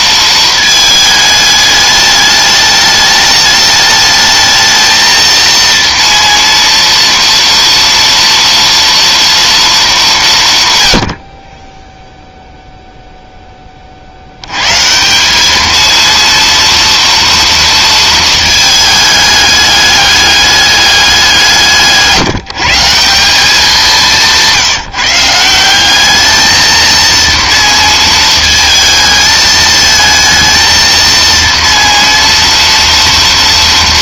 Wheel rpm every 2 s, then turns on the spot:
220, 210, 220, 230, 230, 140, 0, 110, 230, 220, 200, 160, 170, 220, 220, 230, 230.
none